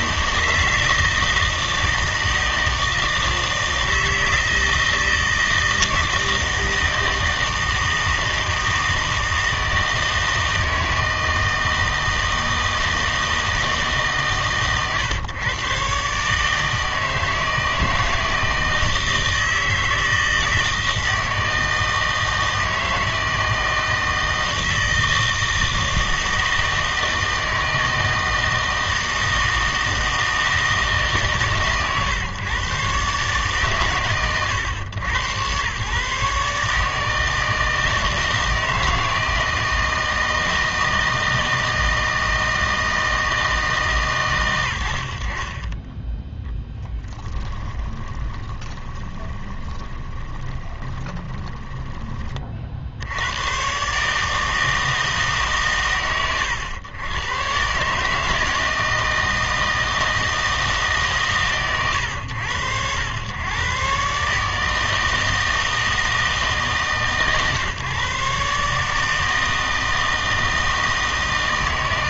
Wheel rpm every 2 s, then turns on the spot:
160, 160, 160, 160, 160, 160, 160, 130, 160, 160, 160, 160, 160, 160, 160, 160, 130, 110, 140, 160, 160, 160, 100, 10, 20, 20, 40, 160, 110, 160, 160, 90, 150, 150, 150, 160.
48-52